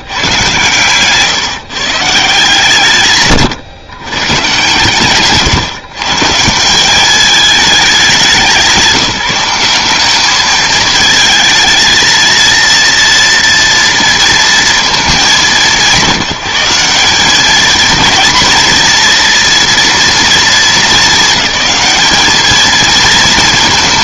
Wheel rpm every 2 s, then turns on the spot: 140, 150, 120, 170, 190, 210, 230, 230, 190, 230, 230, 210.
none